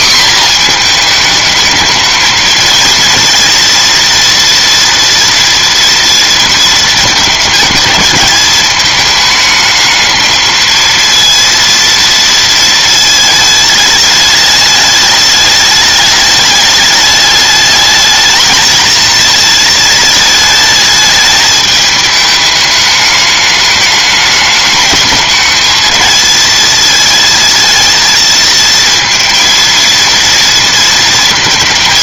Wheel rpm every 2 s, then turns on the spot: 240, 220, 230, 230, 210, 220, 230, 210, 210, 220, 220, 210, 210, 220, 220, 230.
none